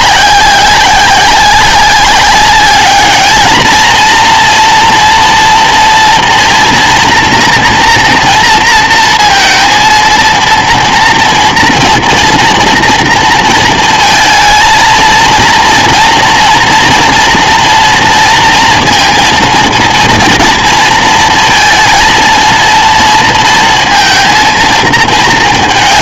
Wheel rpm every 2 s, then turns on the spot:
190, 200, 230, 230, 230, 230, 240, 220, 230, 230, 230, 230, 220.
none